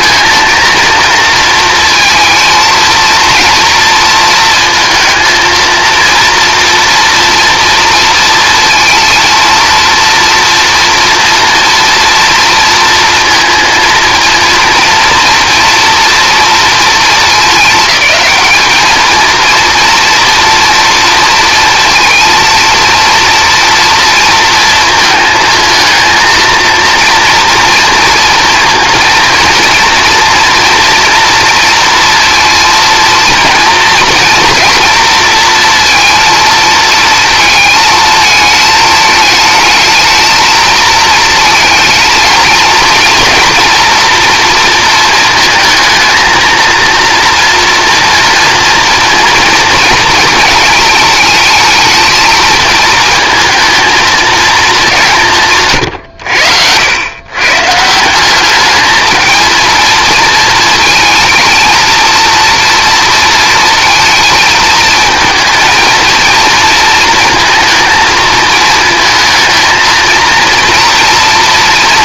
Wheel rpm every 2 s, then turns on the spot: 230, 230, 220, 230, 230, 230, 230, 230, 220, 220, 230, 230, 230, 230, 230, 230, 230, 230, 230, 220, 220, 230, 230, 230, 230, 220, 220, 200, 100, 210, 230, 230, 220, 230, 220, 230.
none